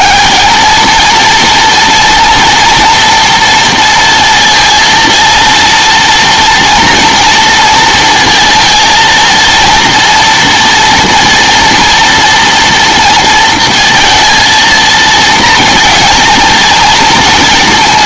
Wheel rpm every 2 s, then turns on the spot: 230, 230, 230, 230, 230, 230, 230, 230, 230.
none